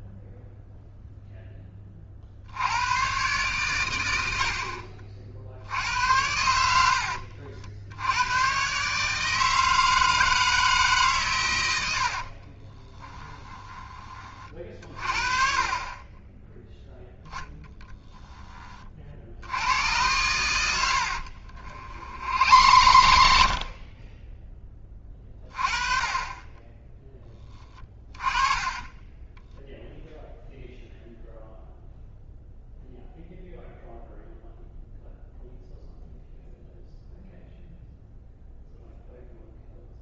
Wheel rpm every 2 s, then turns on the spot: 0, 100, 40, 70, 140, 150, 20, 40, 0, 20, 80, 90, 20, 20, 20, 0, 0, 0, 0, 0.
12-14 22-24